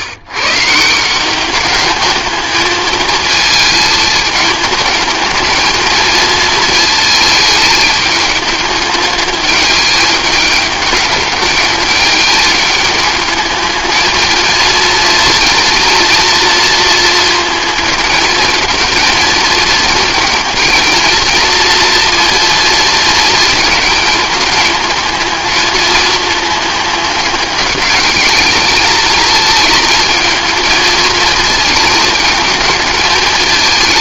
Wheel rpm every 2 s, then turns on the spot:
170, 220, 220, 220, 210, 210, 210, 230, 230, 220, 230, 230, 220, 210, 220, 220, 220.
none